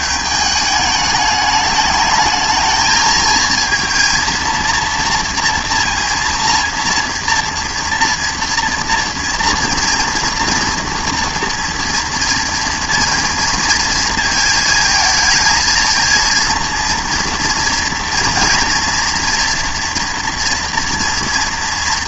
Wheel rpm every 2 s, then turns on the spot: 210, 220, 230, 230, 230, 230, 230, 220, 230, 230, 230.
none